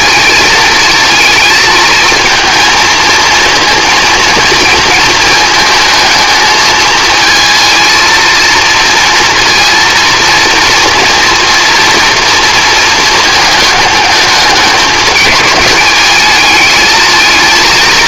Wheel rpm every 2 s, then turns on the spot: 220, 220, 230, 220, 230, 230, 230, 210, 220.
none